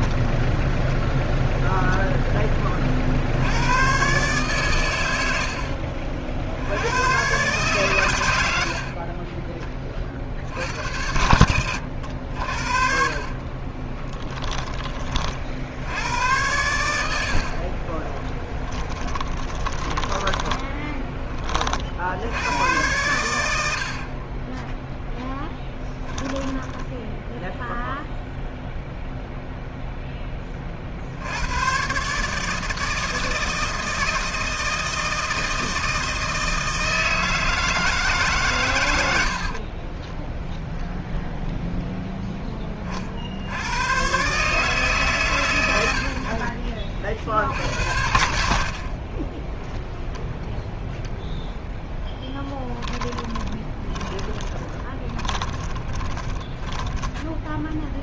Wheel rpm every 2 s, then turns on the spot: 0, 30, 120, 90, 60, 80, 50, 20, 100, 20, 10, 100, 10, 10, 0, 50, 160, 160, 160, 110, 0, 20, 150, 50, 50, 0, 20, 20, 10.
8-10 12-14 18-22 24-28 52-58